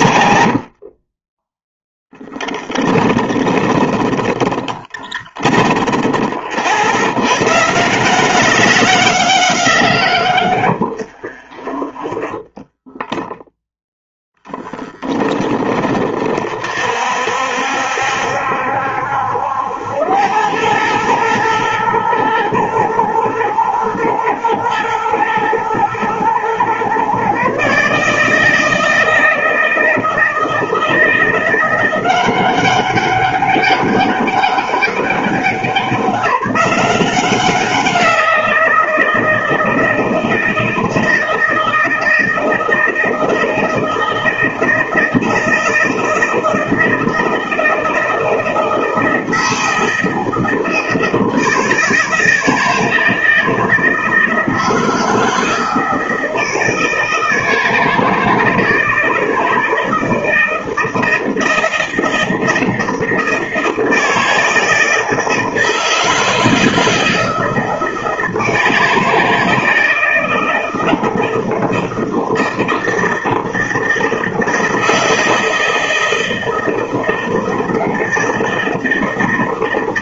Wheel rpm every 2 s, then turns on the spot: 30, 20, 10, 100, 190, 50, 10, 10, 50, 70, 110, 120, 110, 130, 160, 170, 190, 190, 180, 170, 160, 160, 160, 160, 160, 160, 160, 160, 160, 160, 160, 160, 160, 160, 160, 160, 160, 160, 160, 160.
0-6 10-12